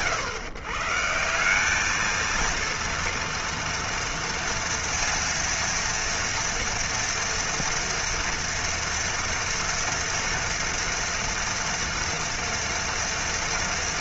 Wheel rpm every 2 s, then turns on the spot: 140, 230, 230, 230, 230, 230, 230.
none